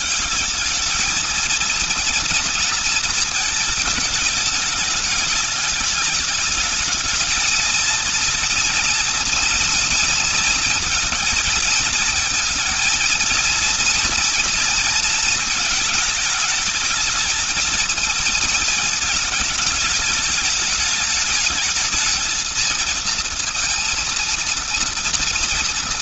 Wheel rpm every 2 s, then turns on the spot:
200, 230, 210, 210, 240, 230, 230, 230, 210, 210, 210, 230, 230.
none